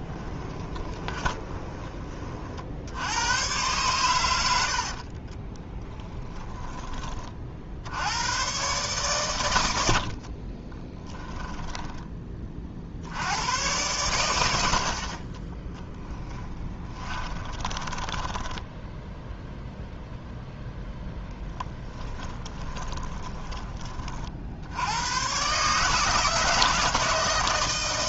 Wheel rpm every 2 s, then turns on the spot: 20, 70, 70, 20, 130, 20, 50, 60, 20, 0, 0, 10, 70, 160.
0-2 4-6 10-12 16-18 22-24